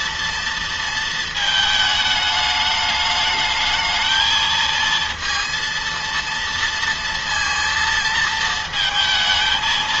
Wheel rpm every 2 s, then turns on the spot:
230, 210, 230, 230, 230.
none